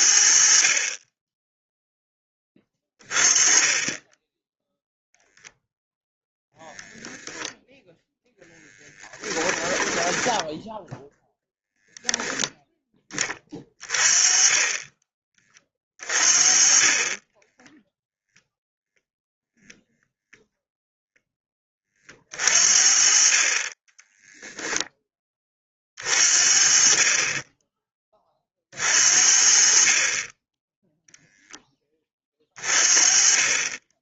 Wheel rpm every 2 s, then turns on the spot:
50, 20, 10, 0, 10, 10, 10, 20, 40, 0, 0, 40, 0, 40, 30, 10, 30.
8-12